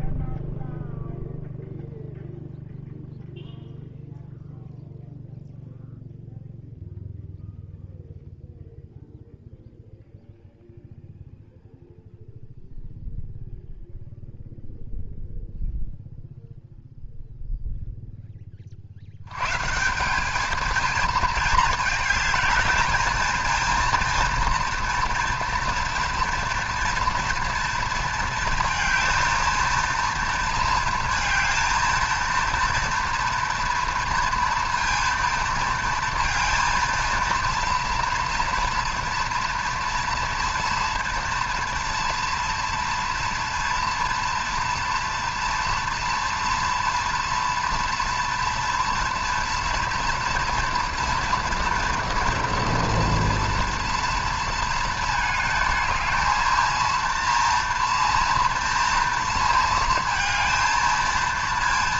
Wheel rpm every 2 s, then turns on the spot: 0, 0, 0, 0, 0, 0, 0, 0, 0, 30, 210, 220, 240, 230, 230, 230, 230, 230, 230, 240, 230, 230, 230, 230, 230, 230, 230, 230, 230, 230, 230.
none